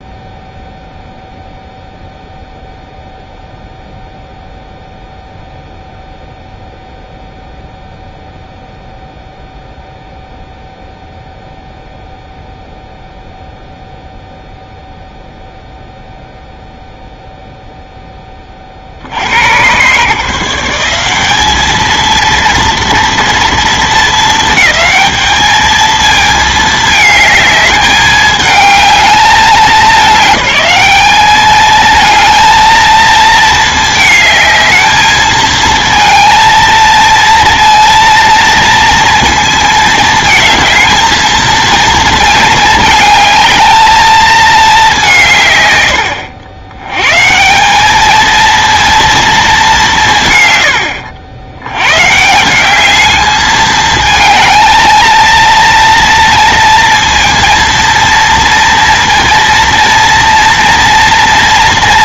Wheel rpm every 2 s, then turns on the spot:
0, 0, 0, 0, 0, 0, 0, 0, 0, 40, 160, 230, 220, 220, 210, 210, 230, 220, 230, 230, 220, 220, 210, 90, 230, 110, 180, 220, 230, 230, 230.
none